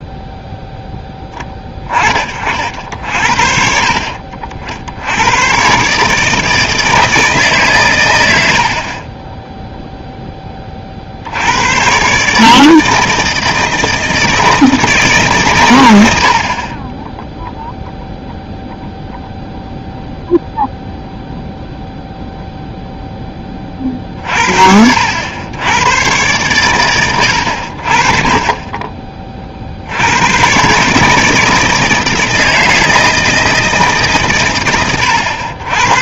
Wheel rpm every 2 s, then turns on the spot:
0, 50, 60, 160, 60, 20, 150, 160, 40, 0, 0, 0, 60, 120, 40, 130, 160, 90.
none